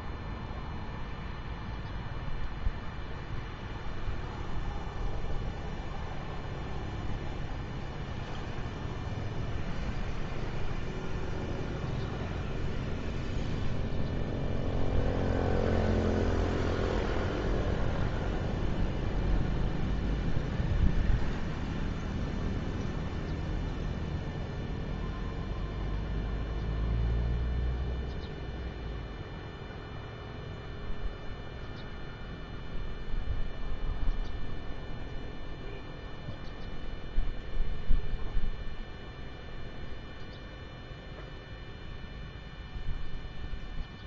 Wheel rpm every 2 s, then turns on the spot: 0, 0, 0, 0, 0, 0, 0, 0, 0, 0, 0, 0, 0, 0, 0, 0, 0, 0, 0, 0, 0, 0.
none